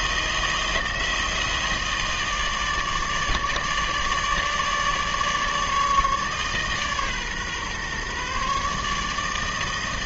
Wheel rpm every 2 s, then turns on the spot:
160, 150, 150, 140, 150.
none